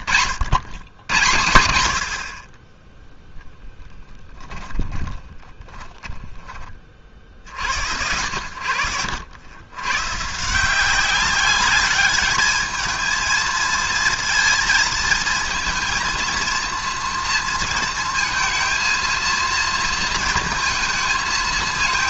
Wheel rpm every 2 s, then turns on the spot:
110, 30, 20, 40, 80, 180, 220, 230, 230, 230, 230.
4-6